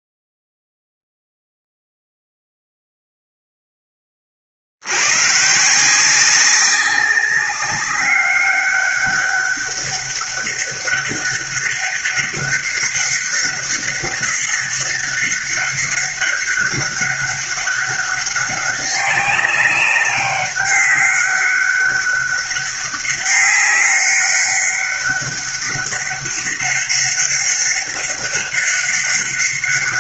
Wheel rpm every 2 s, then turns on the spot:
0, 0, 50, 190, 200, 200, 200, 200, 200, 200, 200, 200, 200, 200, 200.
none